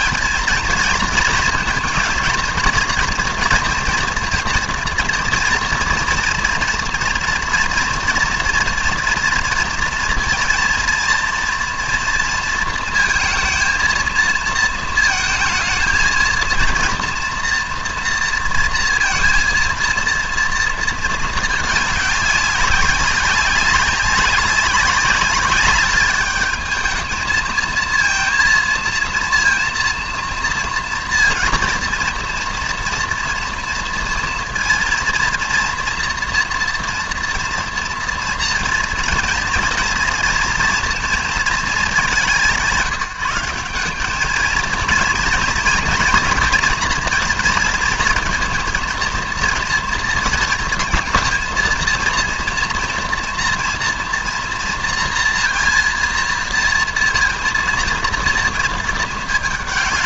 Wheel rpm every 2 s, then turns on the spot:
220, 230, 230, 240, 230, 230, 230, 220, 230, 230, 230, 200, 190, 210, 230, 240, 230, 230, 230, 230, 230, 180, 230, 230, 230, 220, 230, 230, 230, 230.
none